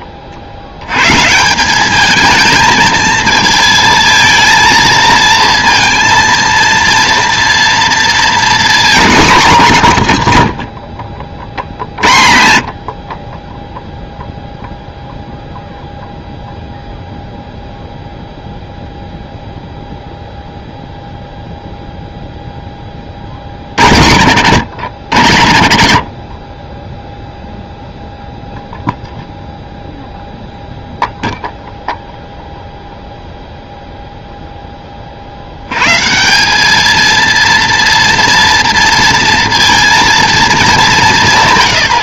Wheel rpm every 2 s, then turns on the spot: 90, 220, 230, 230, 230, 80, 70, 0, 0, 0, 0, 20, 100, 20, 0, 0, 0, 10, 200, 230, 220.
none